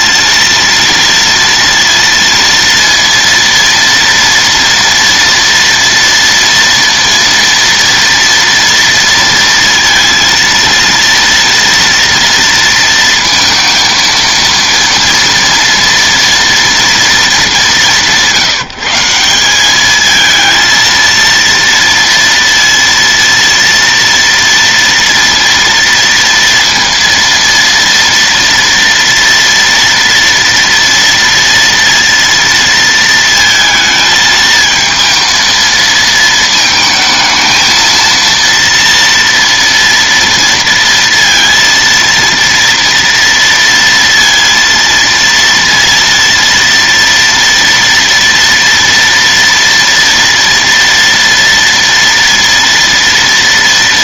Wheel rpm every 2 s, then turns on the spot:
230, 230, 230, 230, 230, 230, 230, 230, 230, 160, 220, 230, 230, 230, 230, 230, 230, 220, 220, 230, 230, 230, 230, 230, 230, 230, 230.
none